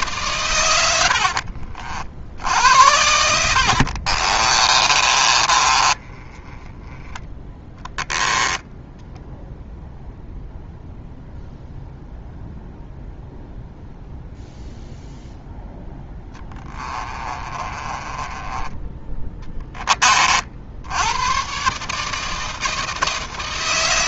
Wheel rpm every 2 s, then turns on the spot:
80, 80, 30, 10, 10, 0, 0, 0, 20, 10, 80, 160.
4-6 8-10 16-20